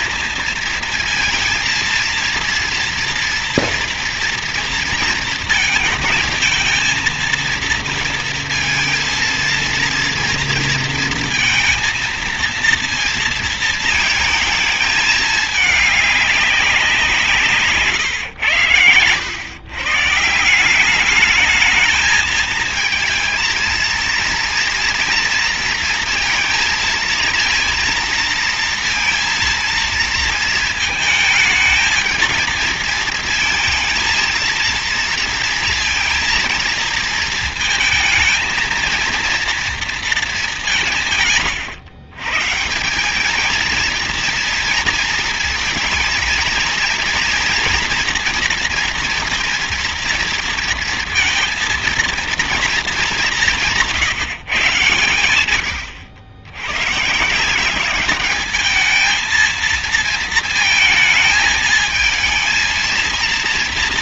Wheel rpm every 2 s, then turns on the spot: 230, 230, 230, 230, 230, 230, 230, 210, 180, 110, 190, 220, 230, 230, 230, 220, 220, 230, 230, 230, 160, 190, 220, 230, 240, 230, 210, 130, 140, 220, 220, 230.
none